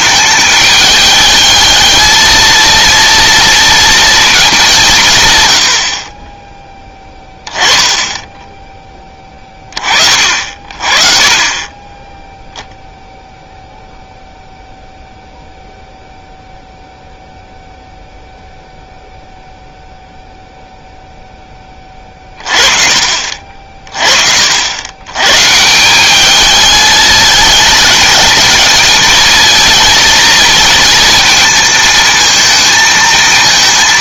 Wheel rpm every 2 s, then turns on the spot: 210, 230, 200, 10, 10, 40, 0, 0, 0, 0, 0, 40, 80, 210, 220, 230, 230.
none